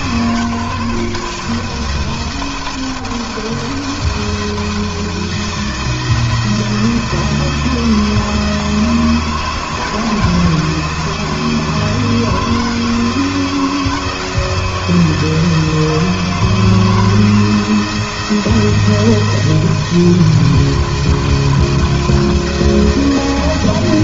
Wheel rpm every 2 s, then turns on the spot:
150, 170, 160, 170, 160, 160, 160, 160, 160, 170, 170, 170.
none